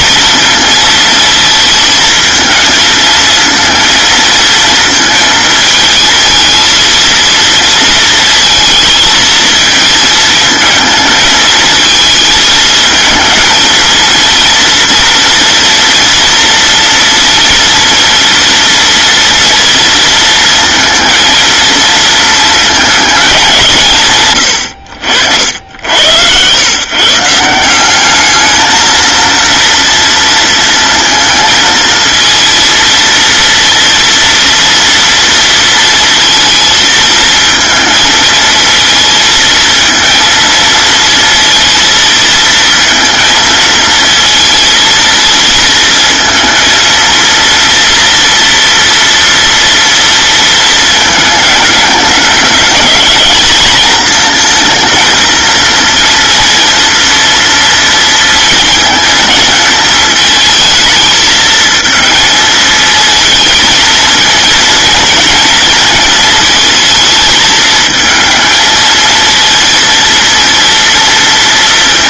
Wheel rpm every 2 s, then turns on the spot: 230, 220, 230, 230, 230, 220, 220, 230, 230, 230, 230, 220, 100, 120, 220, 230, 230, 230, 220, 220, 230, 230, 230, 230, 230, 230, 210, 230, 230, 230, 220, 220, 230, 230, 220, 230.
none